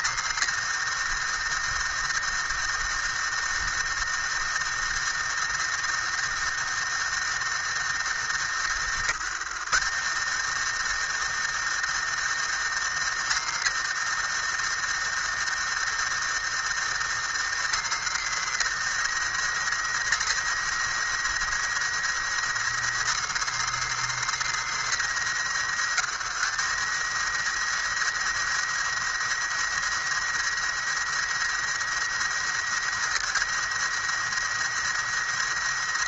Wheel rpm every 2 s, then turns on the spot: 110, 110, 110, 110, 100, 100, 110, 110, 110, 110, 110, 110, 120, 110, 110, 110, 110, 110.
none